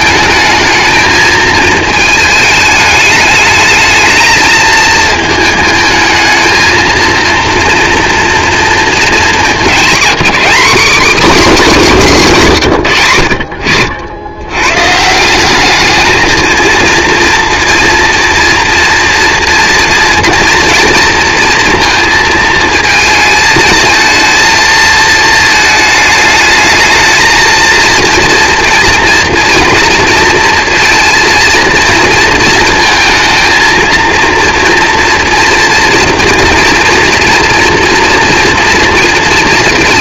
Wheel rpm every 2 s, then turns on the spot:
220, 210, 220, 230, 230, 260, 160, 130, 220, 230, 230, 220, 220, 220, 230, 230, 230, 230, 240, 230.
none